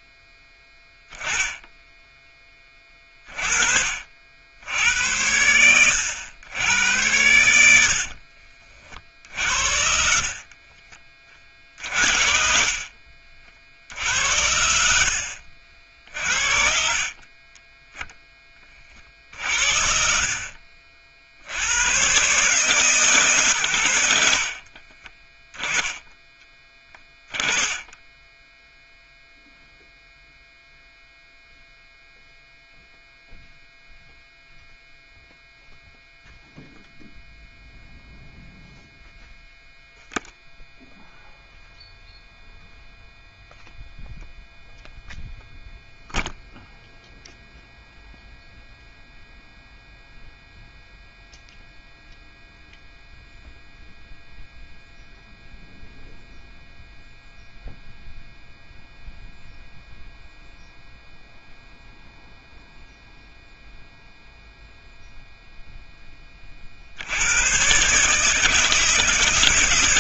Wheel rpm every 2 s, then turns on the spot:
10, 20, 70, 100, 40, 40, 60, 80, 50, 10, 50, 150, 50, 10, 0, 0, 0, 0, 0, 0, 0, 0, 0, 0, 0, 0, 0, 0, 0, 0, 0, 0, 0, 40, 160.
10-12